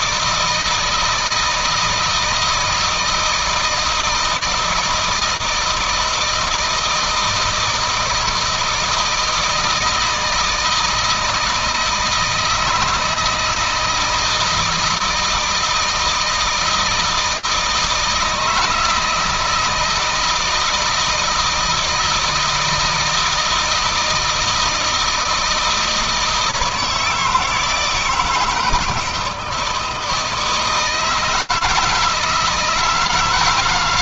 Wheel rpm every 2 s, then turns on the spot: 160, 160, 160, 160, 160, 160, 160, 160, 160, 160, 160, 160, 170, 160, 160, 160, 160.
none